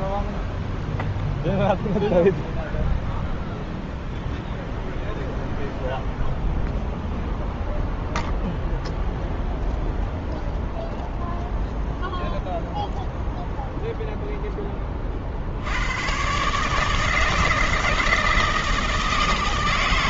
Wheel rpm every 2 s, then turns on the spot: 0, 0, 0, 0, 0, 0, 0, 40, 160, 160.
none